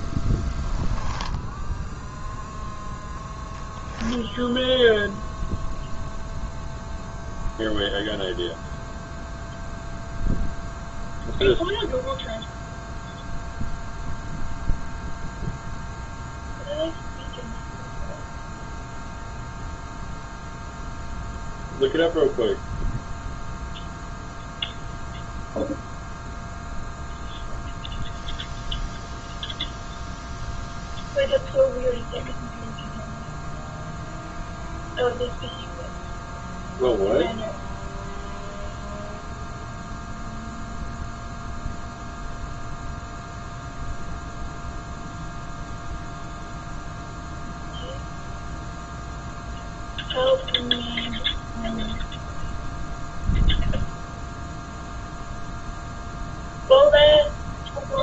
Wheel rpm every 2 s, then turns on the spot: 10, 0, 0, 0, 0, 0, 0, 0, 0, 0, 0, 0, 0, 0, 0, 0, 0, 0, 0, 0, 0, 0, 0, 0, 0, 0, 0, 0, 0.
0-2